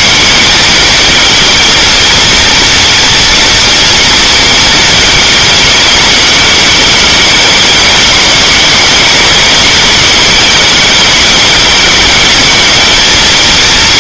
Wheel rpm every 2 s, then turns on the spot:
210, 240, 230, 210, 210, 200, 220.
none